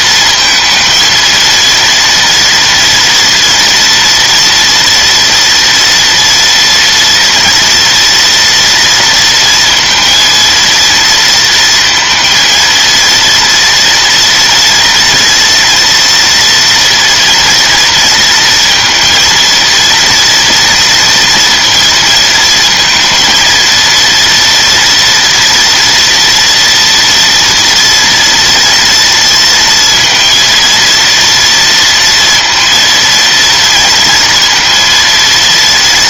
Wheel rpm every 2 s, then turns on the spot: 220, 230, 230, 240, 230, 230, 230, 230, 230, 230, 230, 230, 240, 230, 230, 230, 230, 230.
none